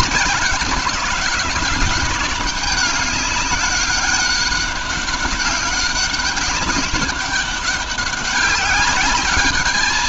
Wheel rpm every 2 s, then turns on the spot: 190, 200, 200, 200, 200.
none